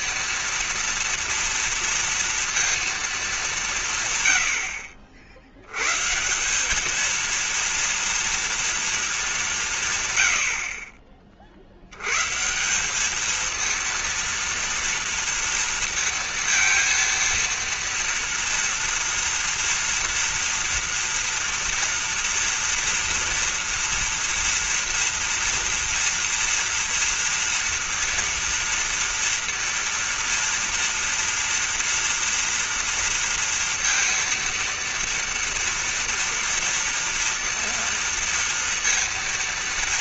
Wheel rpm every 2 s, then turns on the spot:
240, 230, 80, 190, 230, 50, 160, 230, 230, 230, 240, 230, 230, 230, 230, 230, 230, 230, 230, 230.
none